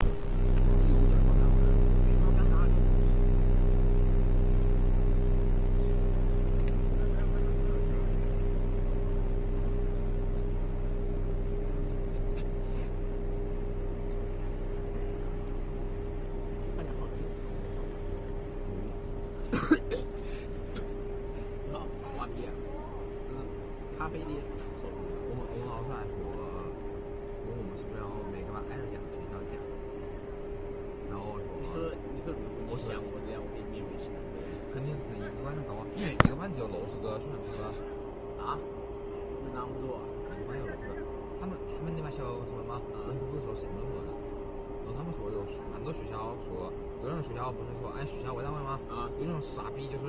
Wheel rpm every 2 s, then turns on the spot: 0, 0, 0, 0, 0, 0, 0, 0, 0, 0, 0, 0, 0, 0, 0, 0, 0, 0, 0, 0, 0, 0, 0, 0, 0.
none